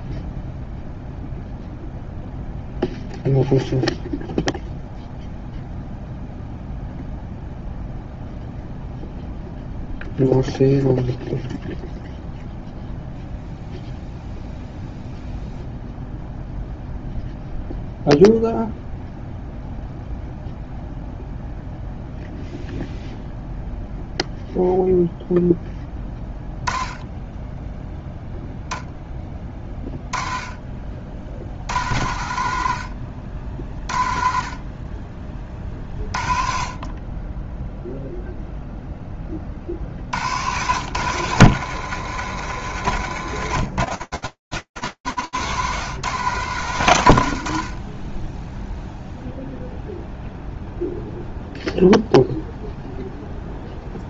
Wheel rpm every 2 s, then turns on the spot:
0, 0, 0, 0, 0, 0, 0, 0, 0, 0, 0, 0, 0, 10, 0, 40, 70, 40, 30, 0, 110, 90, 140, 40, 0, 0, 0.
42-44